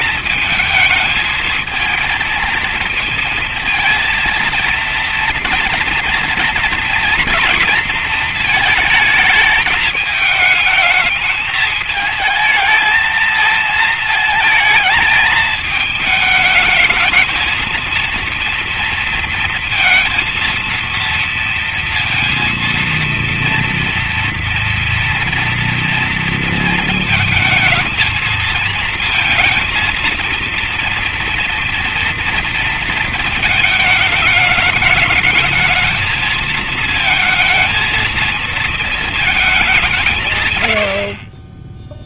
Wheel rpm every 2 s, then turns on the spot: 220, 230, 230, 230, 220, 210, 220, 220, 220, 230, 230, 230, 230, 220, 220, 230, 230, 220, 230, 230, 60.
none